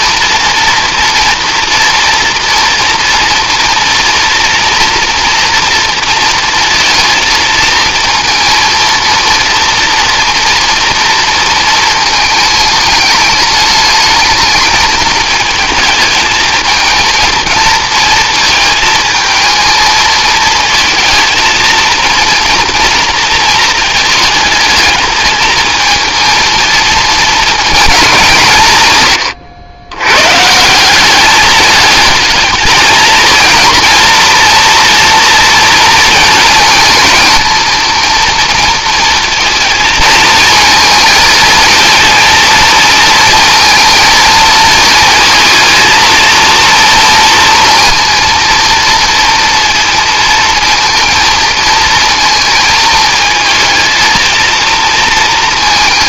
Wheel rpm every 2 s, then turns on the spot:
230, 240, 230, 230, 230, 230, 210, 210, 220, 220, 220, 230, 210, 220, 130, 180, 220, 240, 230, 230, 220, 230, 230, 230, 230, 230, 220, 230.
none